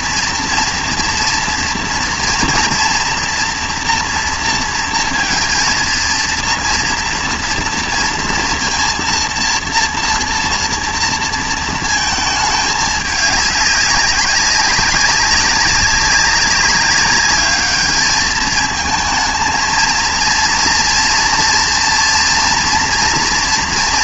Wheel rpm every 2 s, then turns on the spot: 230, 240, 230, 230, 230, 230, 210, 190, 200, 220, 230, 230.
none